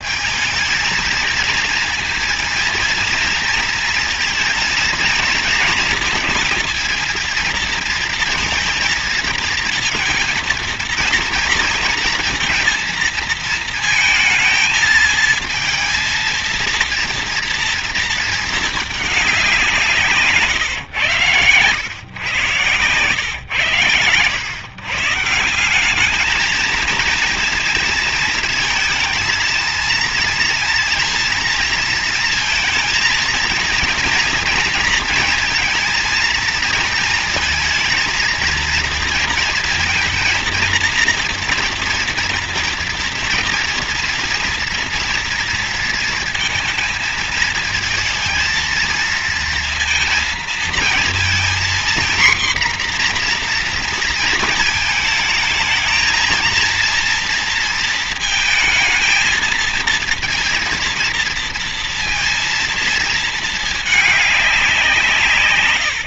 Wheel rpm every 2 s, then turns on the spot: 220, 230, 230, 230, 230, 230, 230, 230, 230, 220, 140, 110, 130, 220, 220, 230, 230, 230, 230, 230, 230, 230, 230, 230, 230, 230, 240, 230, 230, 230, 230, 230, 190.
20-22